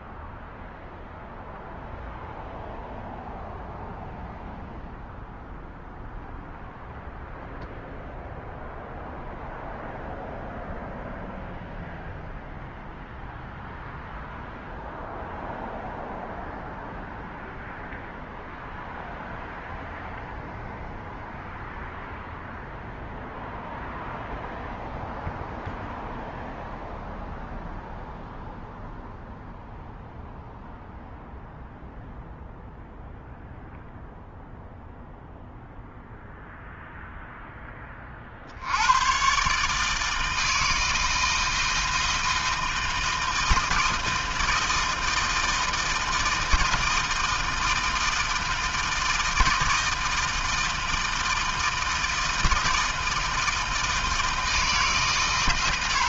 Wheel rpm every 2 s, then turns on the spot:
0, 0, 0, 0, 0, 0, 0, 0, 0, 0, 0, 0, 0, 0, 0, 0, 0, 0, 0, 110, 160, 160, 160, 160, 160, 160, 160, 130.
none